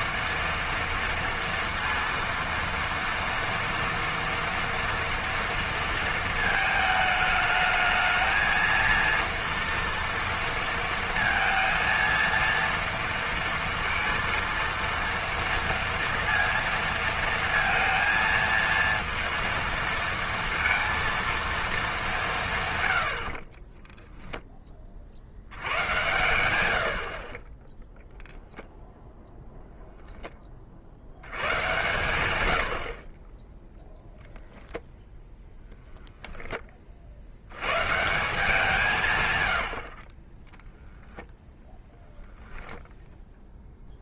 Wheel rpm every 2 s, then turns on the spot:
230, 230, 230, 220, 230, 230, 230, 230, 230, 230, 230, 140, 10, 90, 0, 40, 80, 0, 20, 170, 10, 0.
none